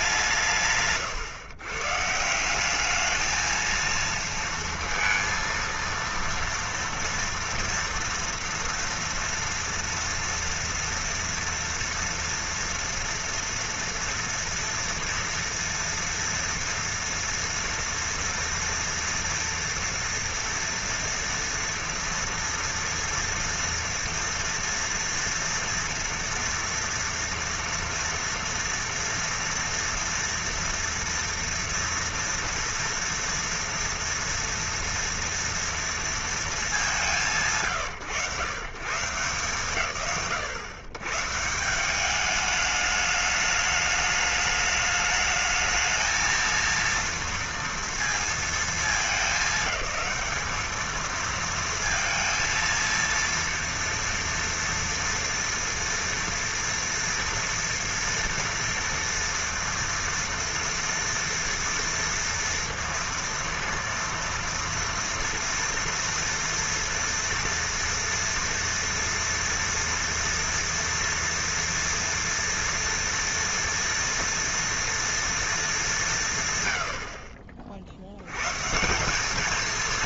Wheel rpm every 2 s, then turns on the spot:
160, 170, 230, 230, 230, 230, 230, 230, 230, 230, 230, 230, 230, 230, 230, 230, 240, 230, 230, 100, 110, 210, 210, 220, 220, 220, 230, 230, 230, 230, 230, 230, 230, 230, 230, 230, 230, 230, 110, 120.
none